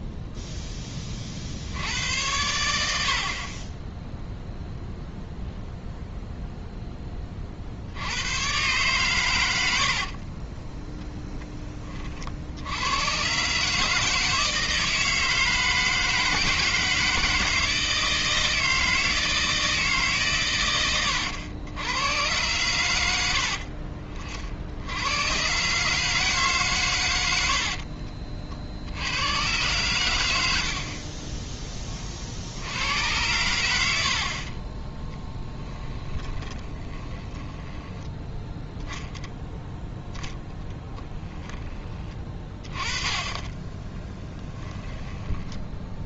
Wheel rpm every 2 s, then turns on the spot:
10, 80, 0, 10, 120, 20, 90, 160, 160, 160, 110, 90, 90, 120, 70, 60, 90, 20, 20, 0, 10, 20, 10.
36-38 44-46